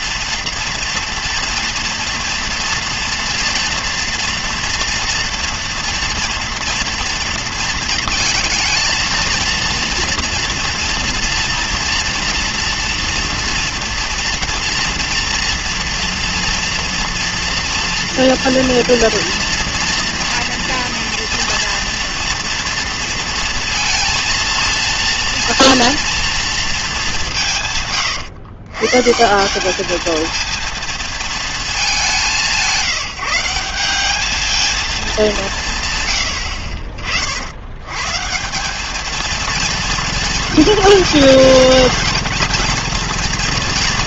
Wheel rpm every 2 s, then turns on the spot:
230, 230, 230, 240, 220, 240, 240, 230, 230, 230, 230, 230, 230, 220, 130, 220, 170, 220, 70, 190, 220, 230.
none